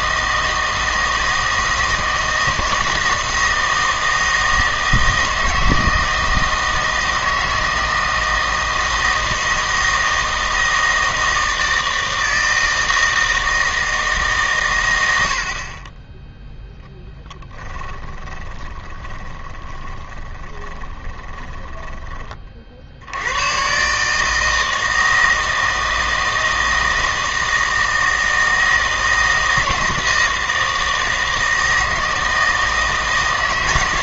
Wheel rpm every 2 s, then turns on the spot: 160, 160, 160, 160, 160, 160, 160, 120, 0, 20, 20, 50, 160, 160, 160, 160, 160.
18-22